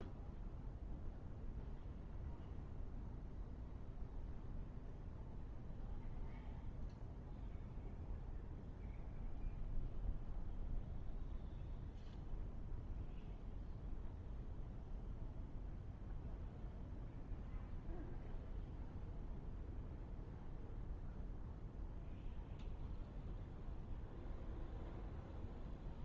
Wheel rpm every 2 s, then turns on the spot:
0, 0, 0, 0, 0, 0, 0, 0, 0, 0, 0, 0, 0.
none